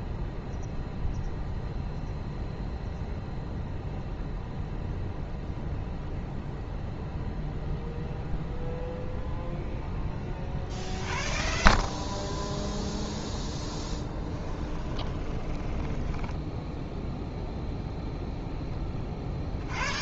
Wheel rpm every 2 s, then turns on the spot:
0, 0, 0, 0, 0, 50, 10, 20, 0, 20.
12-16